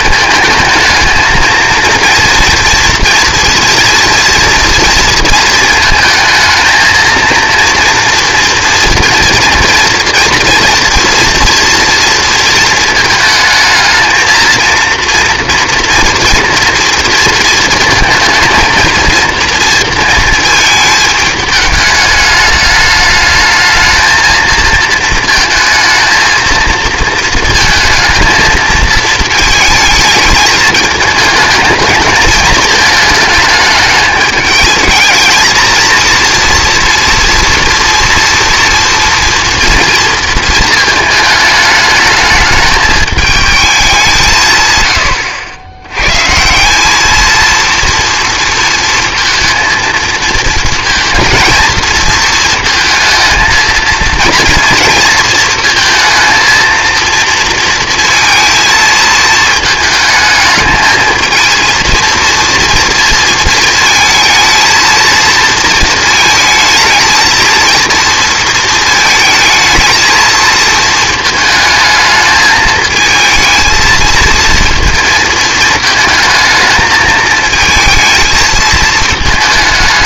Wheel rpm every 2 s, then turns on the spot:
220, 240, 240, 220, 230, 230, 230, 230, 230, 230, 220, 210, 230, 230, 220, 220, 220, 220, 230, 230, 220, 210, 130, 170, 230, 230, 230, 230, 230, 220, 220, 230, 220, 220, 230, 230, 220, 230, 220, 220.
none